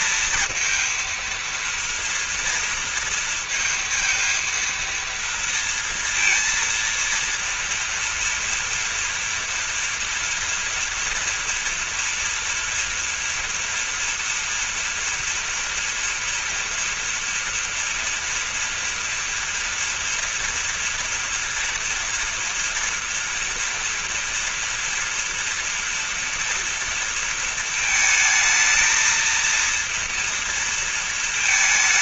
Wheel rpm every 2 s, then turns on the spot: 230, 230, 230, 230, 230, 230, 230, 230, 230, 230, 240, 230, 230, 230, 220, 230.
none